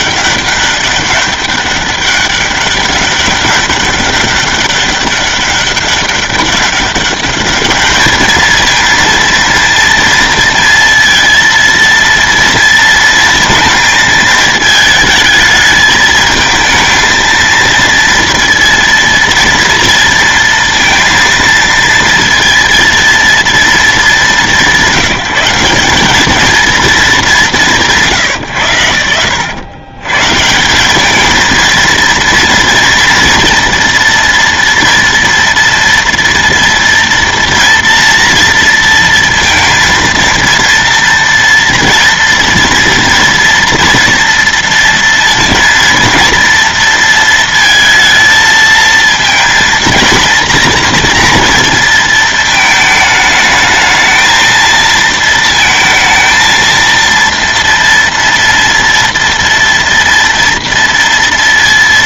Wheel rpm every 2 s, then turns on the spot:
200, 200, 200, 200, 220, 230, 230, 220, 220, 230, 230, 230, 180, 210, 90, 200, 230, 230, 230, 230, 230, 230, 230, 230, 220, 230, 220, 230, 230, 240, 230.
none